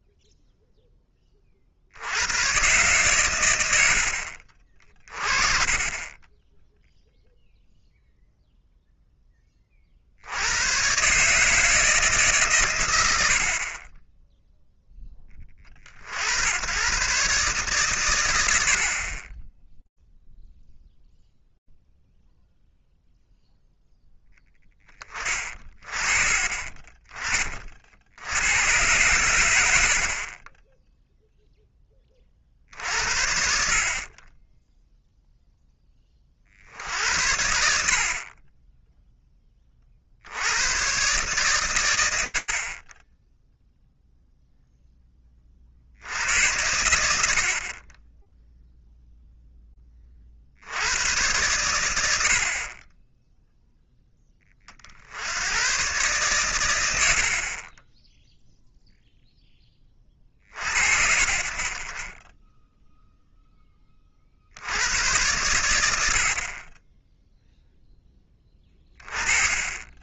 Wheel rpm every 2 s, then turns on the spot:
0, 120, 50, 10, 0, 110, 140, 0, 110, 70, 0, 0, 0, 30, 110, 10, 60, 10, 70, 20, 110, 20, 0, 110, 0, 90, 30, 60, 90, 0, 60, 0, 110, 10, 20.
none